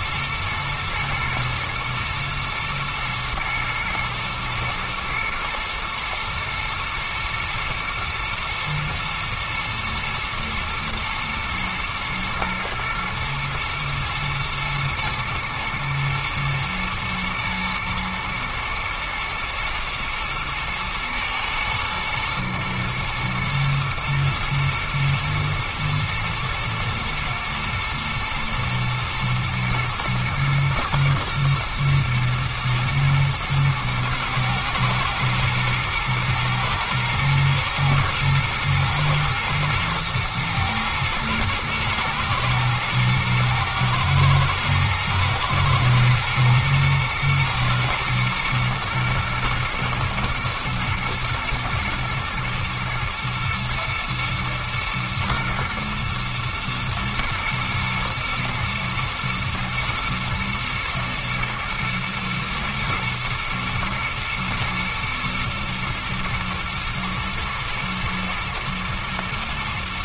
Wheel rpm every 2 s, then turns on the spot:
110, 110, 110, 110, 120, 120, 120, 110, 110, 110, 110, 110, 110, 110, 120, 120, 120, 110, 120, 110, 110, 110, 120, 120, 110, 110, 120, 120, 110, 120, 110, 120, 120, 110, 120.
none